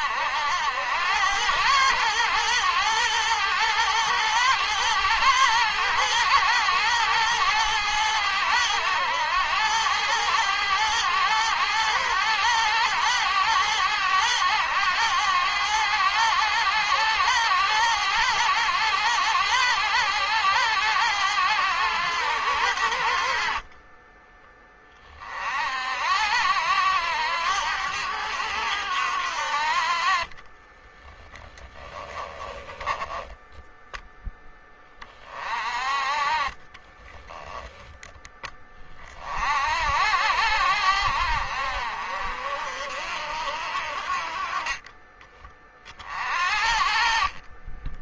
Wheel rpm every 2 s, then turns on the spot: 90, 110, 110, 110, 100, 110, 110, 100, 100, 100, 100, 80, 20, 80, 70, 20, 10, 20, 20, 30, 80, 60, 20, 40.
30-34 36-38